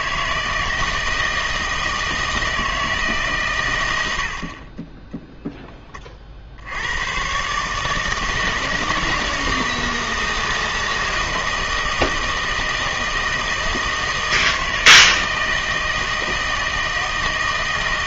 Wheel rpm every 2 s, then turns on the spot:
160, 160, 40, 80, 160, 160, 160, 160, 160.
none